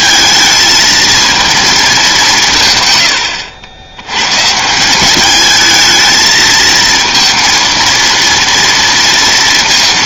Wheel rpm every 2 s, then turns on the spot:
230, 120, 180, 220, 230.
none